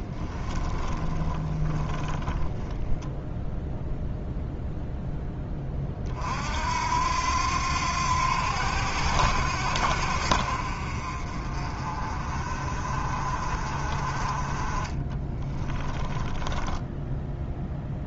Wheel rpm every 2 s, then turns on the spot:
20, 10, 0, 60, 80, 60, 40, 30, 10.
0-2 16-18